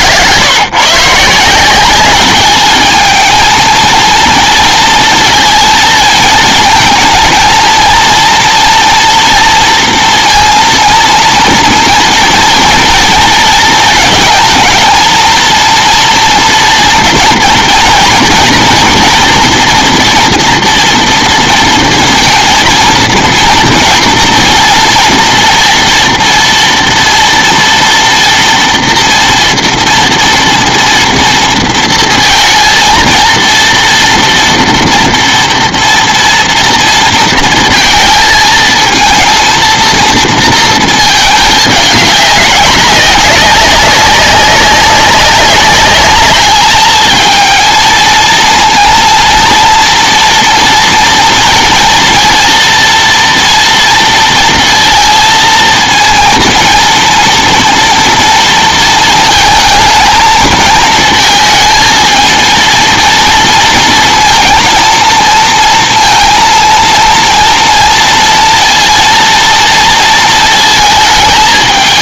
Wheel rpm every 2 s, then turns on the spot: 130, 210, 230, 230, 240, 230, 230, 230, 230, 240, 240, 230, 230, 230, 240, 230, 230, 230, 230, 220, 220, 200, 190, 210, 230, 230, 230, 230, 230, 230, 220, 230, 230, 230, 230, 220.
none